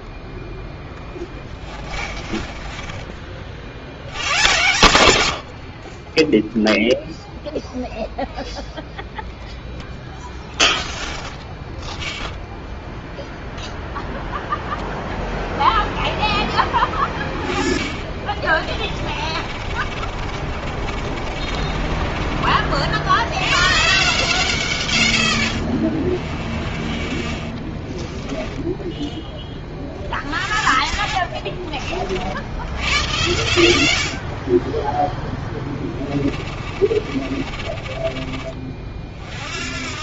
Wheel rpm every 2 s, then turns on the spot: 10, 20, 110, 0, 0, 0, 0, 0, 10, 30, 50, 40, 160, 10, 10, 50, 80, 30, 30, 30.
2-4 18-22 28-30 36-38